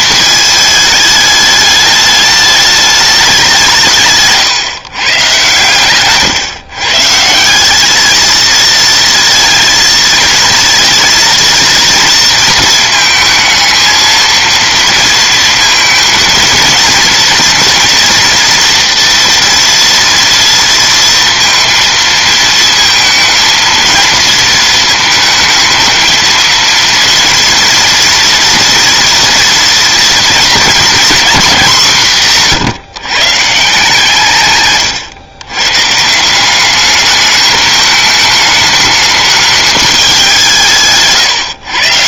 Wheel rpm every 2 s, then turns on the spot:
220, 210, 150, 130, 230, 230, 230, 230, 230, 230, 230, 220, 230, 230, 230, 230, 160, 130, 190, 220, 170.
none